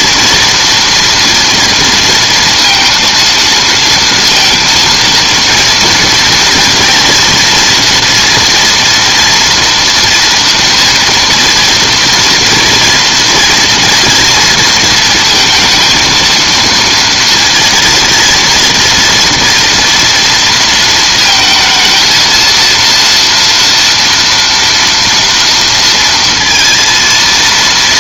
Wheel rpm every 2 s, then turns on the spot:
230, 230, 230, 230, 230, 240, 230, 230, 230, 230, 230, 230, 230, 230.
none